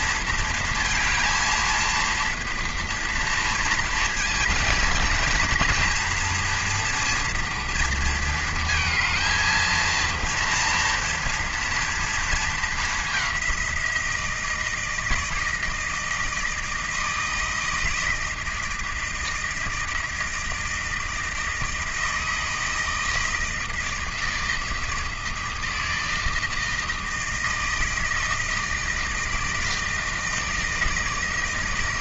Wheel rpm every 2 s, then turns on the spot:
230, 230, 230, 240, 220, 230, 220, 160, 160, 160, 160, 160, 160, 160, 160, 160.
none